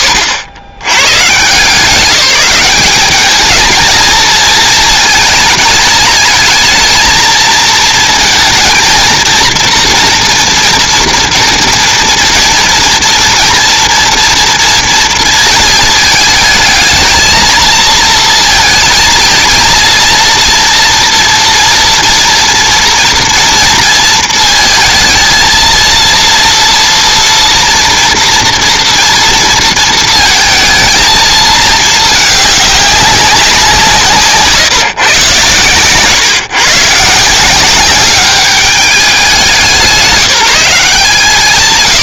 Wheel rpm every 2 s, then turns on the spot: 70, 210, 220, 230, 230, 230, 230, 230, 220, 220, 230, 230, 230, 230, 230, 220, 190, 130, 160, 190, 170.
none